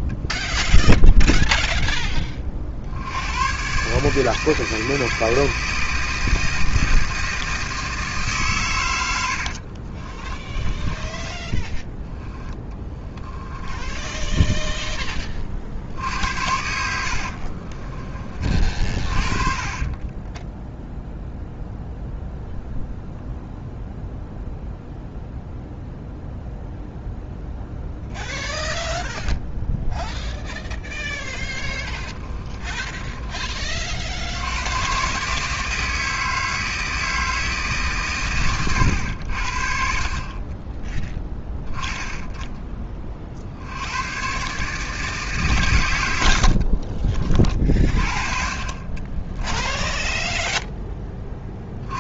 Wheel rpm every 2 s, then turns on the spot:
20, 40, 160, 160, 130, 20, 10, 20, 70, 30, 10, 0, 0, 0, 0, 10, 30, 90, 160, 110, 30, 20, 140, 70, 40, 20.
0-2 10-18 32-34 46-48 50-52